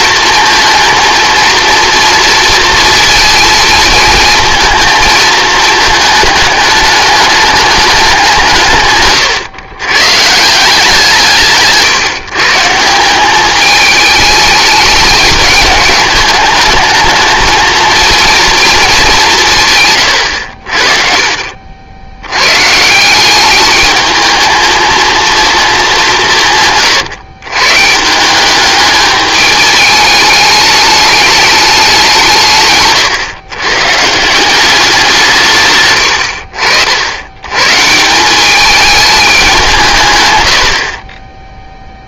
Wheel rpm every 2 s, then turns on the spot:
220, 230, 220, 210, 160, 160, 160, 210, 220, 220, 50, 140, 220, 140, 200, 210, 140, 180, 70, 200, 70.
32-34 40-42